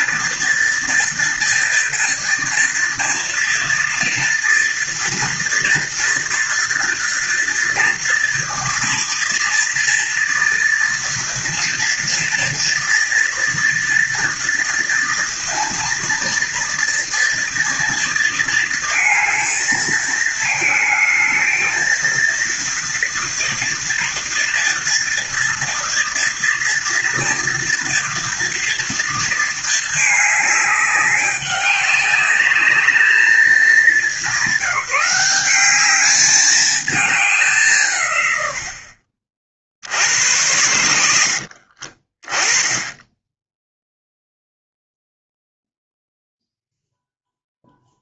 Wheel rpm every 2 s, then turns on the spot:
230, 230, 230, 230, 230, 230, 230, 230, 230, 230, 220, 230, 230, 230, 230, 210, 210, 190, 210, 70, 90, 10, 0, 0.
none